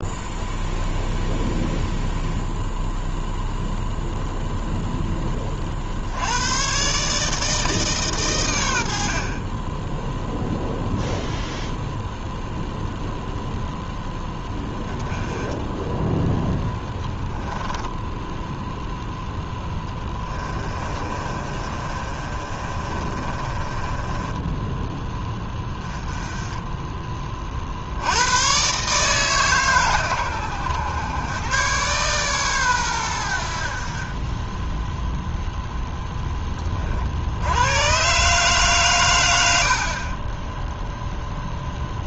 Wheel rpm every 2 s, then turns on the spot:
0, 0, 0, 130, 80, 0, 0, 30, 10, 0, 30, 30, 10, 20, 140, 100, 110, 0, 40, 130, 0.
16-18 20-24